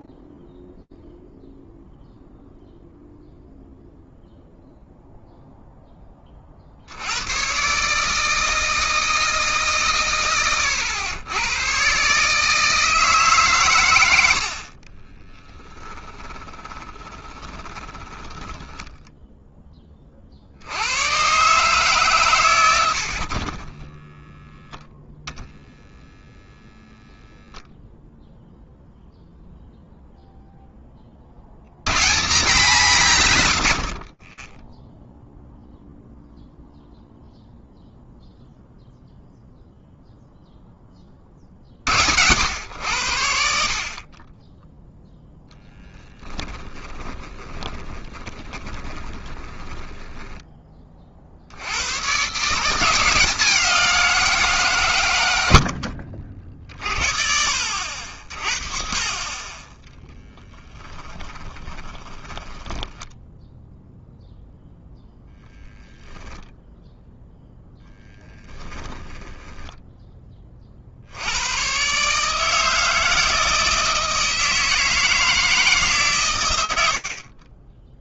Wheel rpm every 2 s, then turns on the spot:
0, 0, 0, 0, 80, 160, 100, 150, 20, 20, 10, 130, 20, 0, 0, 0, 190, 0, 0, 0, 40, 50, 0, 20, 20, 60, 180, 80, 50, 30, 20, 10, 0, 0, 10, 30, 160, 160, 130.
16-20 24-26 46-50 60-64 68-70